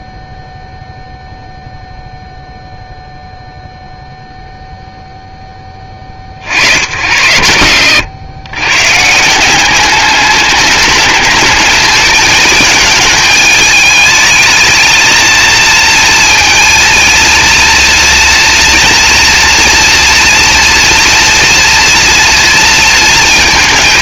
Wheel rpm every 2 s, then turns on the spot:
0, 0, 0, 110, 150, 210, 220, 220, 230, 240, 240, 230.
none